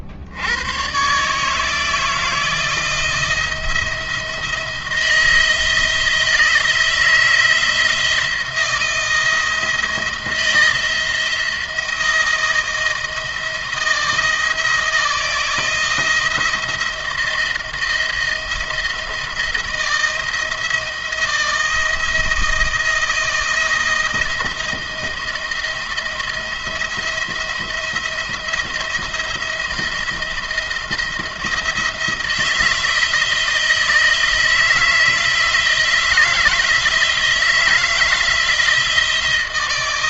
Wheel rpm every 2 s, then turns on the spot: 90, 160, 170, 160, 170, 170, 160, 160, 170, 170, 170, 170, 170, 170, 170, 170, 160, 160, 160, 160.
none